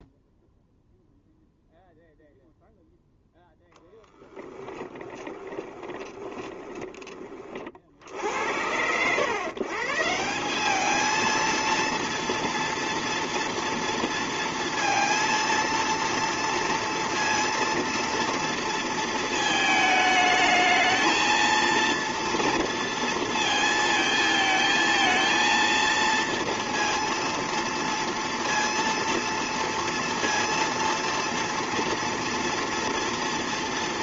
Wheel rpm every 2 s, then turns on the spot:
0, 0, 10, 20, 90, 210, 230, 230, 230, 230, 220, 230, 220, 230, 230, 230, 230.
4-8